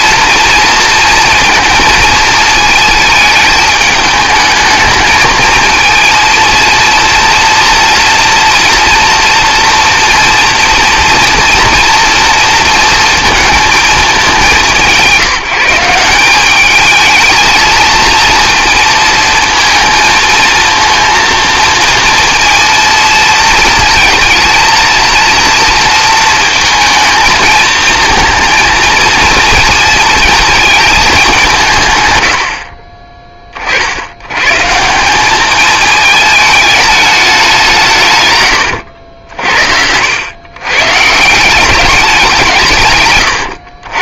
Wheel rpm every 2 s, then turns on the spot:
230, 220, 220, 230, 230, 230, 230, 200, 210, 230, 230, 230, 230, 220, 230, 220, 60, 140, 210, 110, 130, 150.
38-40